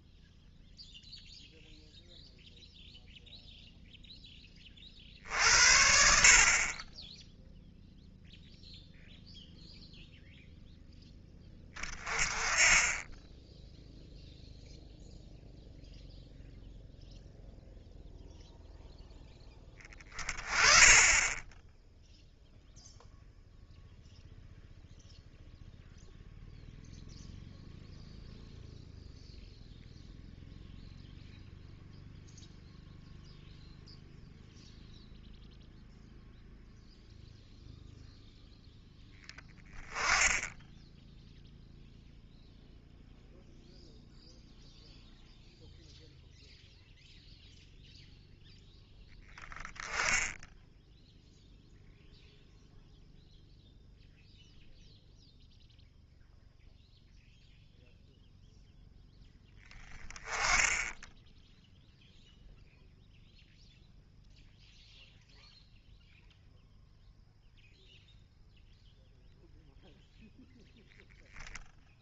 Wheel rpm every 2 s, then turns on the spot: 0, 0, 10, 50, 0, 0, 20, 0, 0, 0, 20, 0, 0, 0, 0, 0, 0, 0, 0, 0, 10, 0, 0, 0, 0, 10, 0, 0, 0, 0, 10, 0, 0, 0, 0, 0.
none